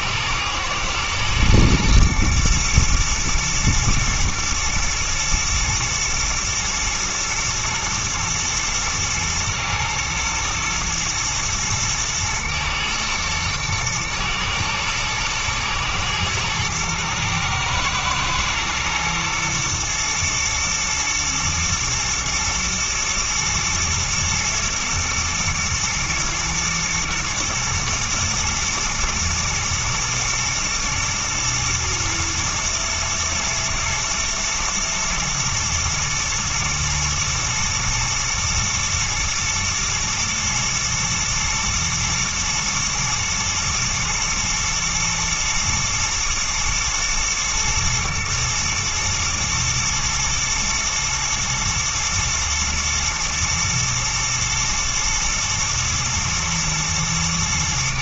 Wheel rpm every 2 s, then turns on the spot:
120, 120, 120, 110, 120, 110, 110, 110, 110, 120, 120, 120, 120, 110, 110, 120, 120, 120, 110, 110, 120, 110, 120, 120, 120, 110, 110, 110, 110.
none